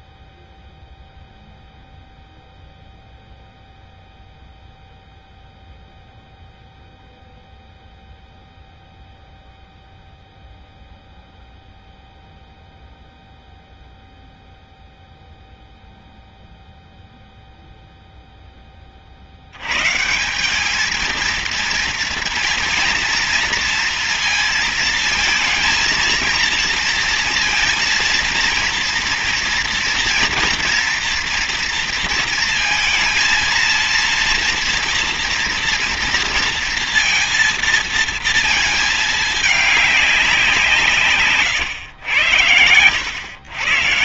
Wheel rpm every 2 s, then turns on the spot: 0, 0, 0, 0, 0, 0, 0, 0, 0, 10, 190, 230, 230, 230, 230, 230, 230, 230, 230, 230, 180, 100.
none